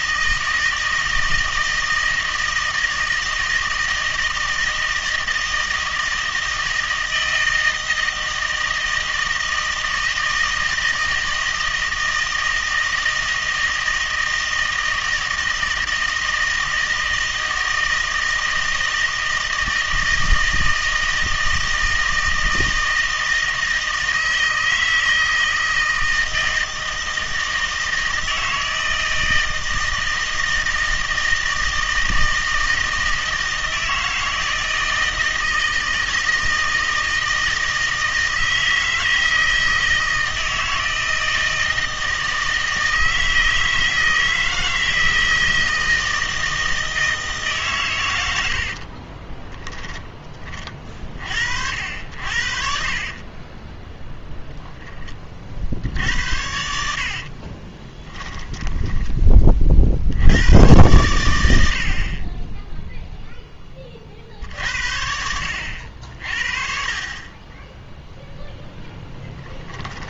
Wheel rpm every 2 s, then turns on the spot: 160, 160, 160, 160, 160, 160, 160, 160, 160, 160, 160, 160, 160, 160, 160, 160, 160, 160, 160, 160, 160, 160, 160, 160, 70, 30, 60, 0, 80, 10, 110, 10, 60, 40, 0.
48-50 52-54 58-60